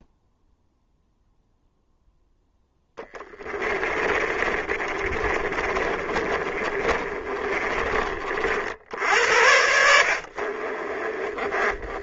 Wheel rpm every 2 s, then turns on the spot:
0, 10, 20, 30, 70, 30.
2-8 10-12